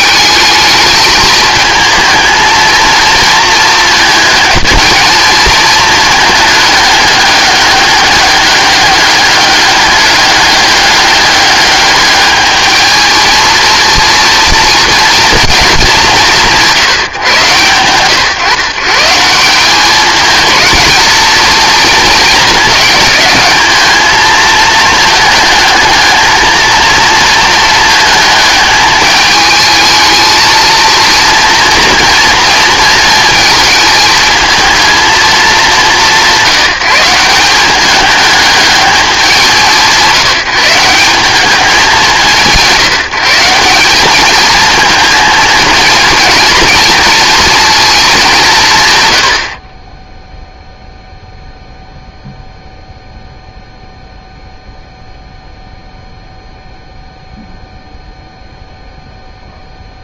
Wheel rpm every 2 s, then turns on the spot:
220, 230, 220, 210, 200, 200, 220, 230, 170, 130, 220, 220, 220, 230, 220, 230, 230, 230, 180, 210, 170, 170, 220, 230, 180, 0, 0, 0, 0, 0.
none